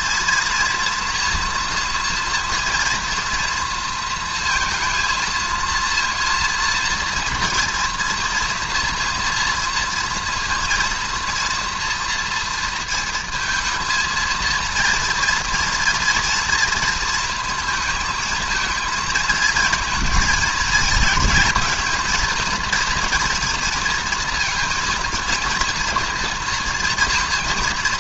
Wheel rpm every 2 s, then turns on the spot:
230, 230, 230, 230, 240, 230, 230, 230, 230, 220, 220, 230, 230, 230.
none